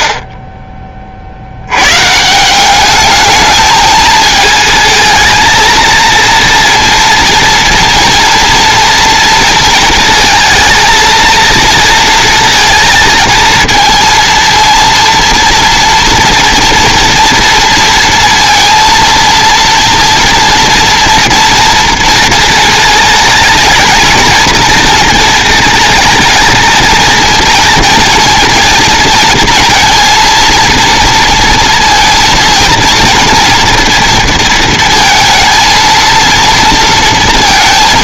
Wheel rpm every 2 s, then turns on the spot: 20, 200, 220, 230, 230, 230, 230, 230, 230, 230, 230, 220, 220, 220, 230, 230, 230, 230, 230.
none